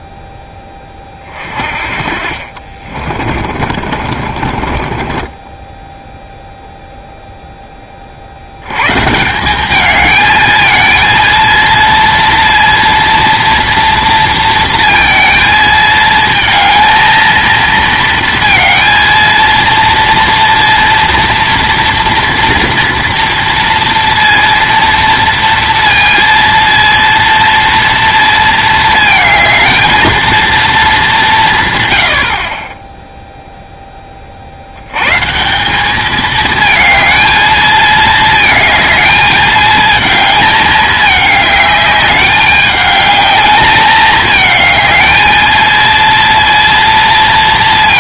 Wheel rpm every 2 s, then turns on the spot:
10, 40, 40, 0, 100, 220, 230, 230, 230, 230, 240, 230, 230, 230, 230, 220, 30, 70, 220, 220, 220, 210, 210, 230.
2-6